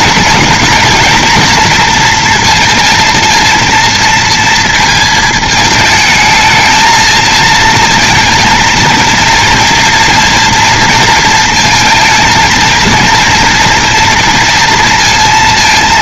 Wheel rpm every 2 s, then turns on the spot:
220, 230, 230, 220, 230, 230, 230, 230.
none